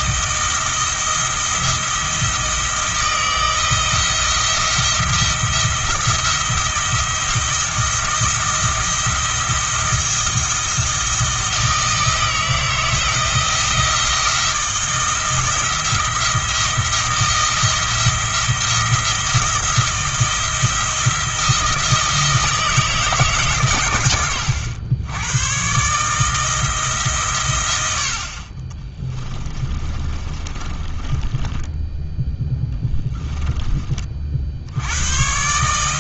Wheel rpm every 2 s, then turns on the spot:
170, 170, 170, 160, 170, 160, 160, 160, 170, 170, 170, 160, 100, 160, 20, 20, 10, 90.
28-34